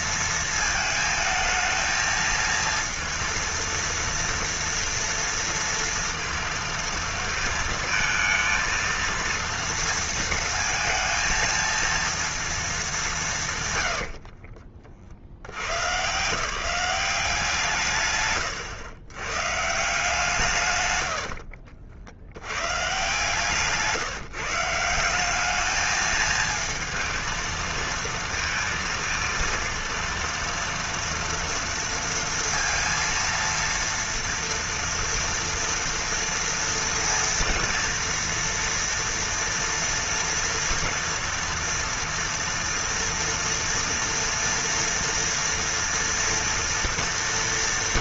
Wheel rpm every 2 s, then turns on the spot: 220, 230, 230, 230, 230, 230, 210, 50, 190, 130, 120, 170, 170, 230, 230, 230, 230, 230, 230, 230, 230, 230, 230, 230.
none